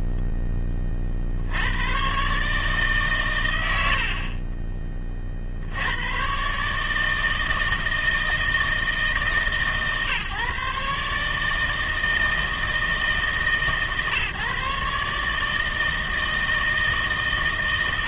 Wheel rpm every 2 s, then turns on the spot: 40, 110, 60, 130, 160, 140, 160, 140, 160.
none